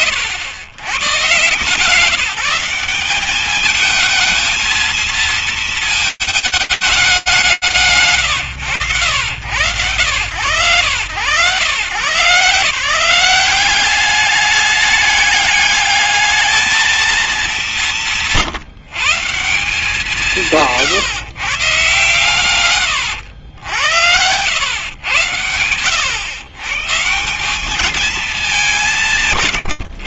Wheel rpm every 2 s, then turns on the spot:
100, 190, 230, 220, 100, 130, 180, 200, 210, 170, 150, 90, 110, 180, 140.
none